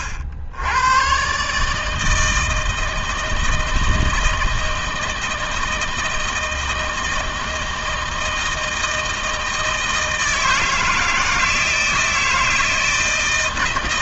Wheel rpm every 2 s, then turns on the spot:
90, 160, 160, 160, 160, 160, 160.
none